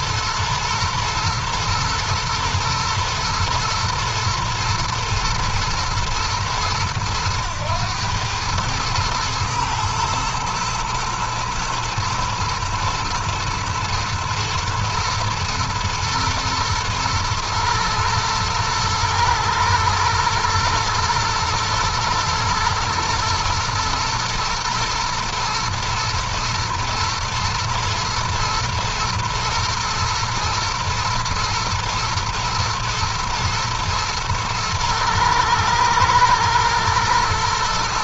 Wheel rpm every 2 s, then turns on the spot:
120, 110, 120, 110, 110, 120, 120, 110, 110, 120, 110, 110, 120, 120, 120, 120, 110, 110, 120.
none